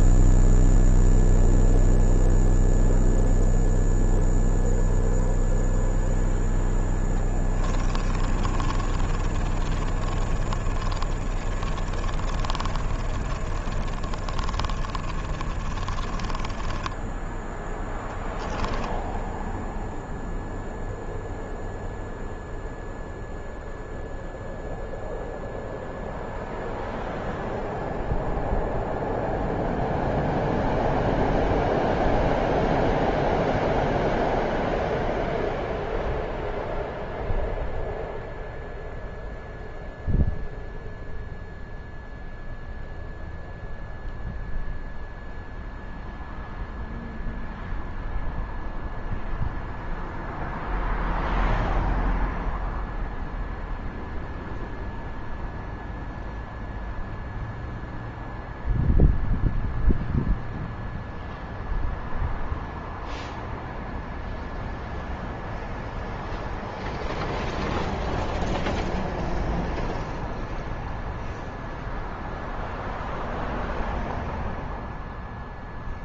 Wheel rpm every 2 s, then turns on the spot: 0, 0, 0, 10, 30, 30, 30, 30, 20, 10, 0, 0, 0, 0, 0, 0, 0, 0, 0, 0, 0, 0, 0, 0, 0, 0, 0, 0, 0, 0, 0, 0, 0, 0, 0, 0, 0, 0.
8-20